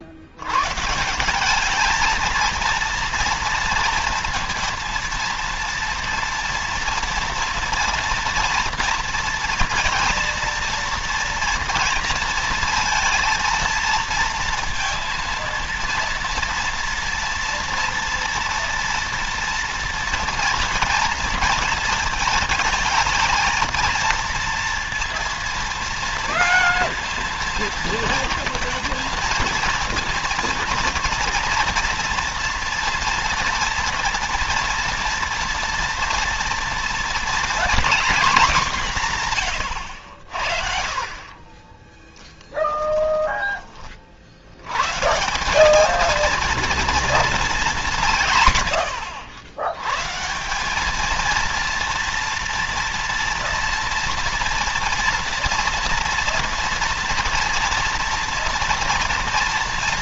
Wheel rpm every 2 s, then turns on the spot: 70, 220, 230, 230, 240, 230, 230, 230, 230, 230, 230, 220, 230, 230, 230, 230, 240, 230, 230, 240, 80, 20, 40, 210, 170, 130, 230, 230, 230, 230.
42-44